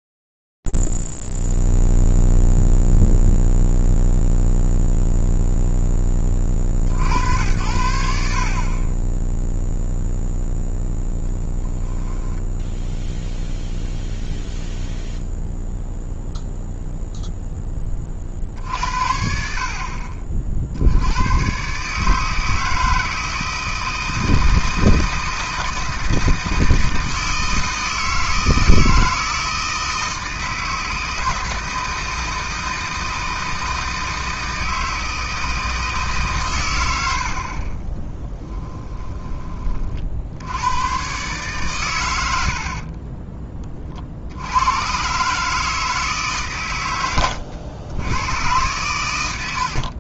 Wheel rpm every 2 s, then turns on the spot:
0, 0, 0, 10, 70, 0, 10, 0, 0, 60, 60, 160, 160, 160, 160, 160, 160, 160, 100, 10, 120, 30, 120, 100, 100.
42-44